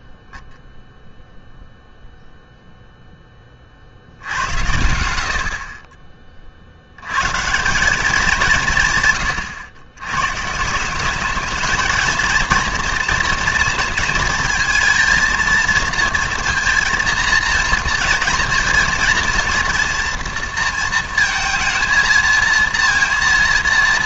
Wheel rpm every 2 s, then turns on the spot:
0, 0, 90, 50, 170, 160, 240, 220, 230, 230, 230, 230.
none